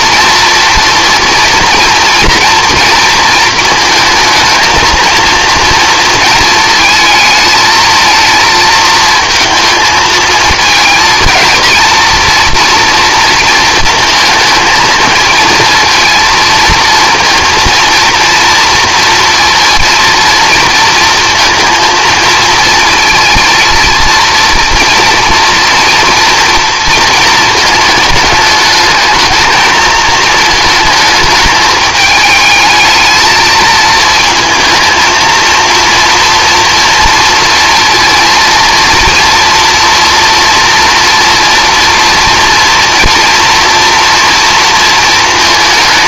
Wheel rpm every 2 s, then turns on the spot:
230, 230, 220, 220, 230, 230, 230, 220, 230, 230, 230, 230, 240, 230, 220, 220, 220, 230, 240, 230, 240, 240, 230.
none